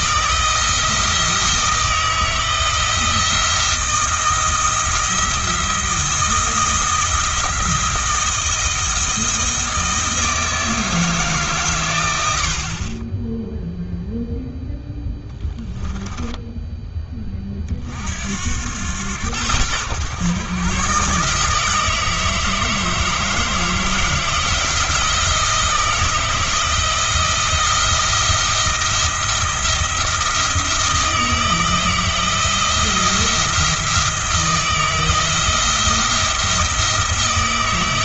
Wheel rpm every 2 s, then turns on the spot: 170, 170, 170, 170, 170, 160, 40, 0, 10, 90, 130, 160, 170, 160, 170, 160, 170, 170, 160.
none